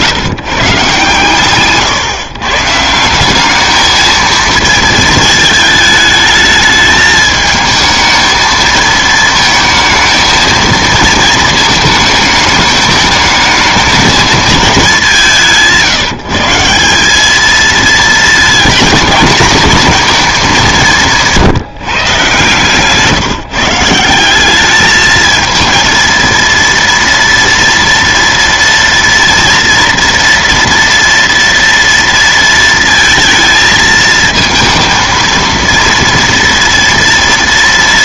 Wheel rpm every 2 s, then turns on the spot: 140, 150, 220, 220, 220, 230, 220, 210, 170, 220, 180, 140, 210, 230, 230, 230, 230, 230, 230.
none